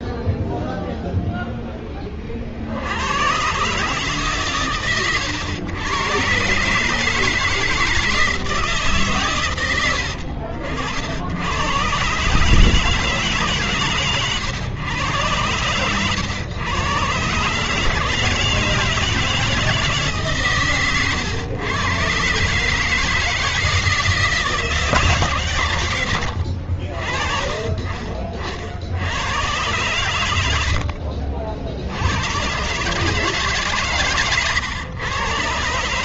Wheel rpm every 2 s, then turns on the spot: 0, 80, 120, 140, 150, 70, 150, 120, 110, 160, 140, 140, 150, 50, 50, 70, 120, 110.
30-32